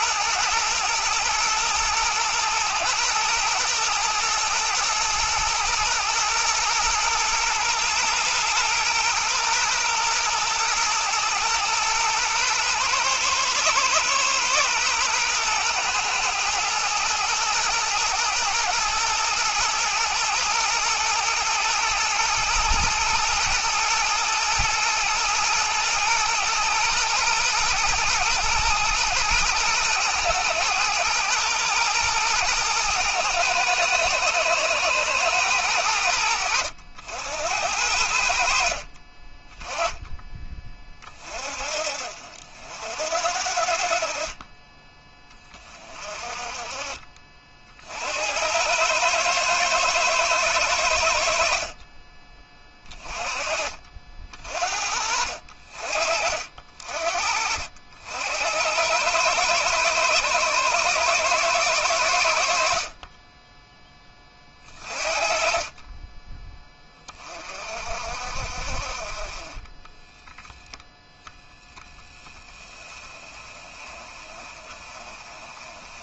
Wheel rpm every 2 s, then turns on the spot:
110, 120, 120, 120, 110, 120, 110, 120, 120, 110, 120, 110, 110, 120, 110, 110, 110, 110, 70, 40, 30, 60, 20, 30, 110, 70, 30, 50, 50, 100, 110, 40, 40, 20, 40, 0, 20, 30.
none